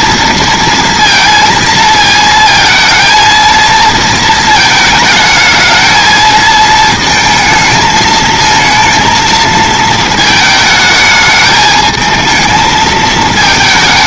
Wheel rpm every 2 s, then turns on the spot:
230, 230, 220, 220, 220, 220, 220.
none